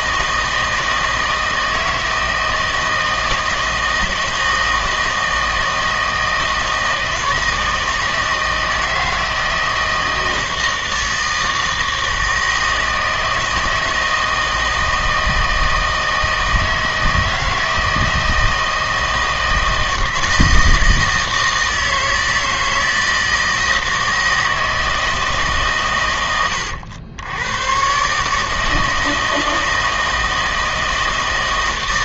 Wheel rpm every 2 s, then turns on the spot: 160, 160, 160, 160, 160, 160, 160, 160, 160, 160, 160, 160, 160, 100, 160, 160.
none